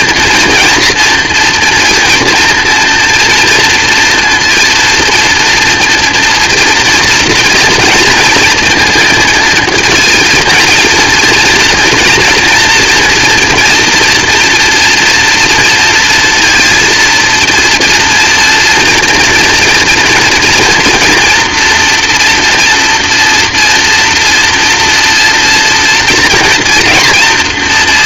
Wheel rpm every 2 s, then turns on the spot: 230, 230, 230, 230, 230, 240, 240, 230, 230, 230, 240, 230, 230, 240.
none